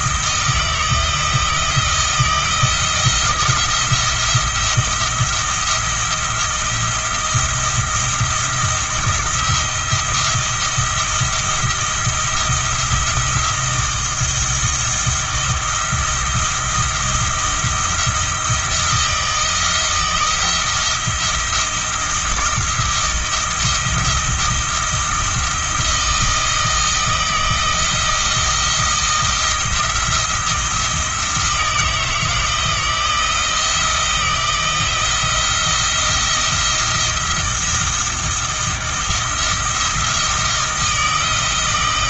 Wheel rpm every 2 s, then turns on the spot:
160, 170, 170, 170, 170, 170, 170, 170, 170, 170, 170, 170, 170, 160, 170, 160, 160, 170, 170, 170, 160.
none